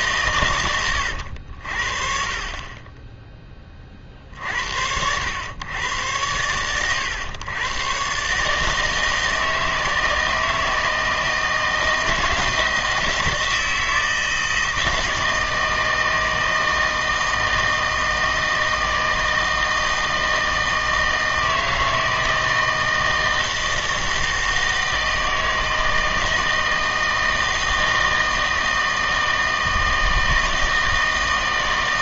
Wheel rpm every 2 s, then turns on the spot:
120, 30, 60, 110, 150, 160, 170, 160, 160, 160, 160, 160, 160, 160, 160, 160.
none